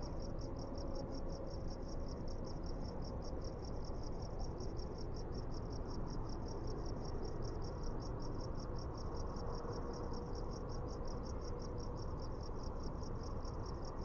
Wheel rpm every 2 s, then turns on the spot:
0, 0, 0, 0, 0, 0, 0.
none